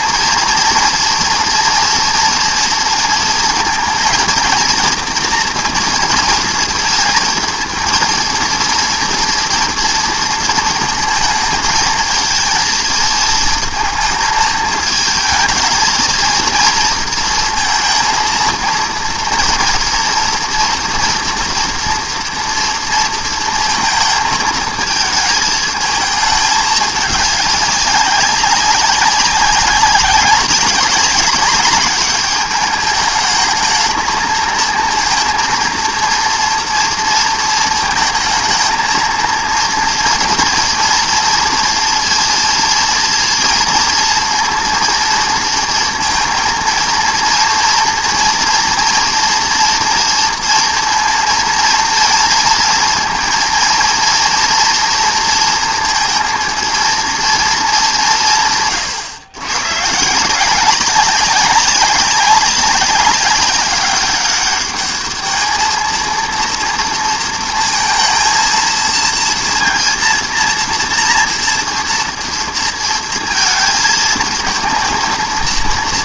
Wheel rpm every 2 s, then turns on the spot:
230, 230, 230, 230, 230, 230, 220, 220, 230, 230, 230, 230, 220, 220, 200, 190, 200, 220, 230, 220, 230, 230, 230, 230, 230, 230, 230, 230, 230, 170, 150, 200, 200, 230, 230, 230, 230, 220.
none